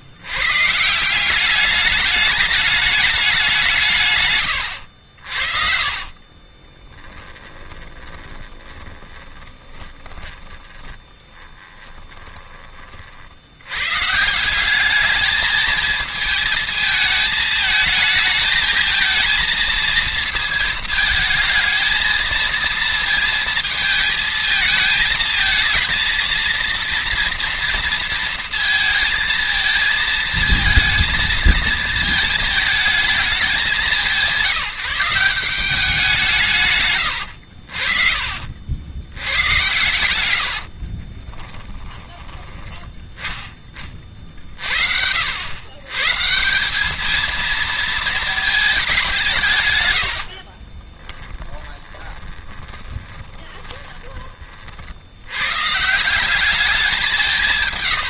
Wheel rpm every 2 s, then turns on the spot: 150, 210, 80, 20, 20, 20, 40, 190, 220, 220, 220, 230, 220, 230, 230, 230, 220, 180, 130, 90, 50, 10, 70, 190, 200, 40, 30, 70, 190.
6-12 40-42 50-54